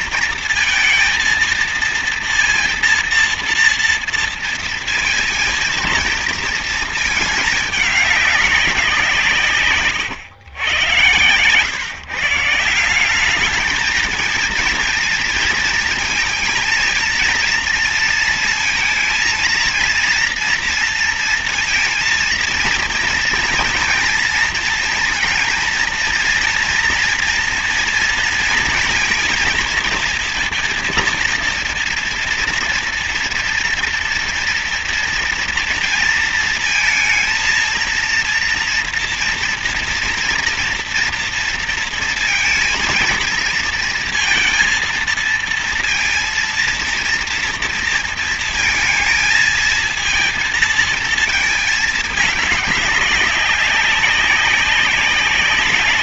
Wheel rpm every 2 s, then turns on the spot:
230, 230, 230, 230, 190, 110, 170, 220, 220, 230, 230, 230, 230, 230, 230, 230, 230, 230, 230, 230, 230, 230, 230, 230, 230, 230, 200, 200.
none